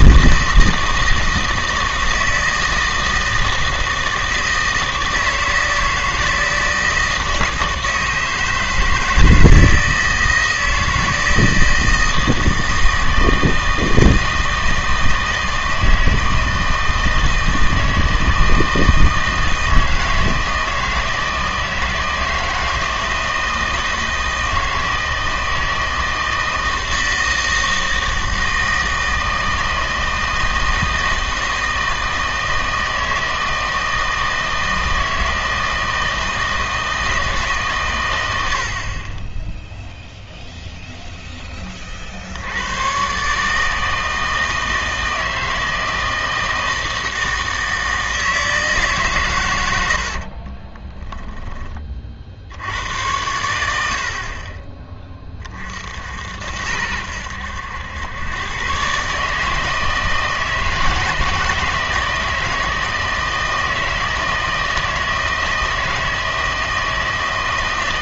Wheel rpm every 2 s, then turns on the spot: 160, 160, 160, 160, 160, 160, 160, 160, 160, 160, 160, 160, 160, 160, 160, 160, 160, 160, 160, 60, 0, 100, 160, 160, 150, 20, 80, 30, 80, 130, 160, 160, 160, 160.
50-52